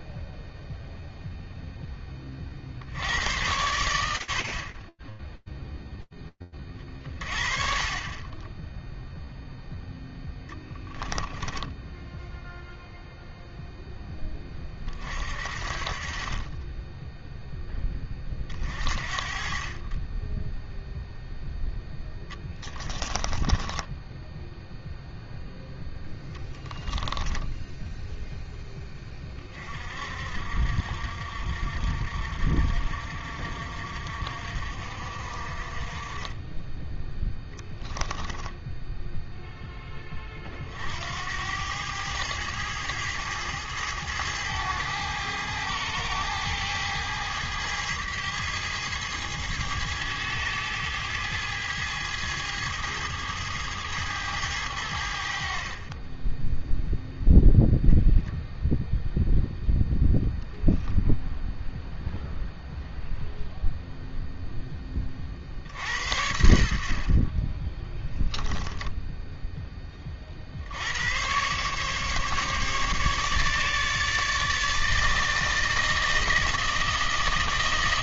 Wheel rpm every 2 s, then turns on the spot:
0, 90, 10, 30, 0, 10, 0, 40, 10, 40, 0, 10, 0, 10, 40, 60, 60, 40, 0, 0, 80, 110, 110, 110, 110, 110, 110, 70, 0, 0, 0, 0, 30, 50, 10, 110, 150, 160, 160.
10-12 22-24